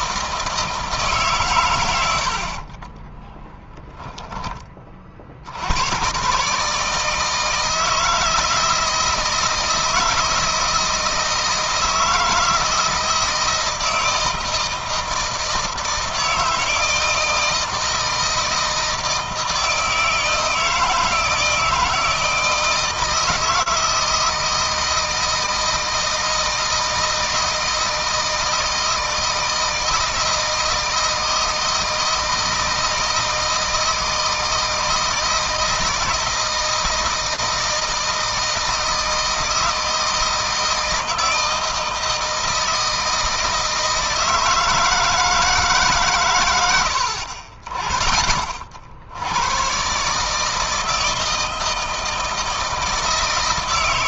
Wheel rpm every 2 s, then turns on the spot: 150, 30, 40, 160, 160, 160, 160, 160, 160, 160, 160, 160, 160, 160, 160, 160, 160, 160, 160, 160, 160, 160, 160, 80, 60, 160, 160.
2-4